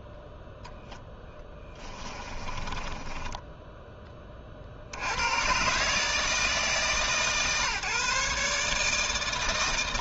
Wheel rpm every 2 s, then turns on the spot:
0, 20, 50, 140, 150.
2-4